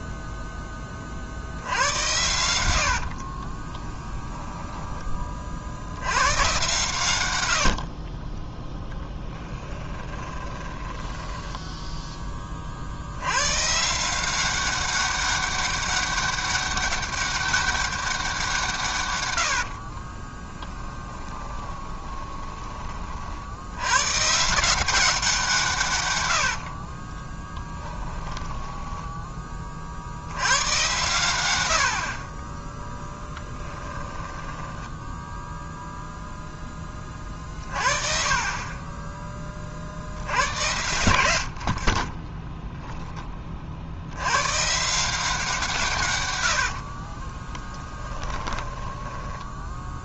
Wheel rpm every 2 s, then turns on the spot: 20, 100, 10, 130, 10, 10, 40, 190, 200, 160, 10, 30, 170, 40, 10, 100, 10, 10, 20, 30, 90, 10, 130, 60, 20.
4-6 10-12 26-30 34-36 46-50